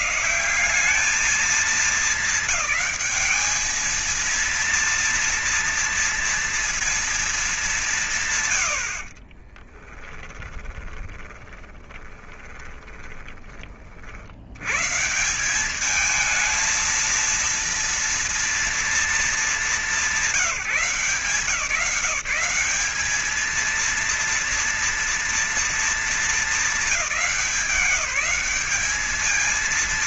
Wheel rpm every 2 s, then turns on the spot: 190, 190, 230, 230, 100, 20, 20, 100, 220, 230, 180, 180, 230, 210, 190.
8-14